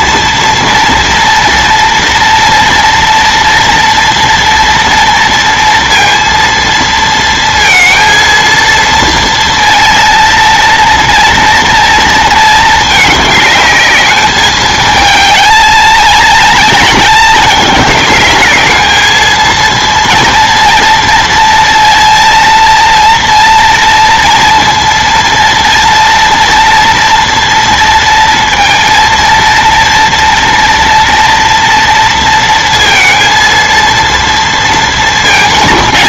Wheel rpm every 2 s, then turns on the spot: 230, 230, 230, 230, 230, 230, 220, 210, 230, 210, 230, 230, 230, 230, 230, 240, 230, 230.
none